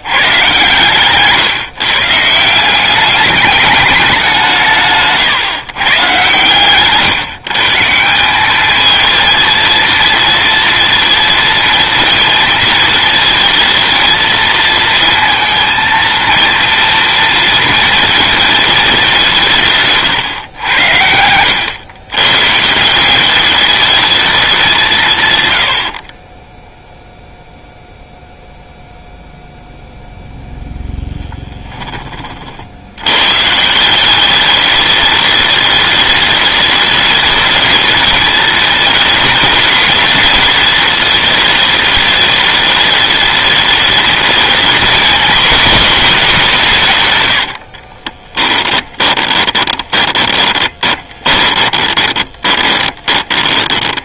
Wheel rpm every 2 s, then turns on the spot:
130, 190, 160, 140, 220, 230, 230, 230, 230, 210, 90, 170, 160, 0, 0, 10, 90, 210, 210, 220, 210, 210, 220, 150, 20, 20, 20.
48-54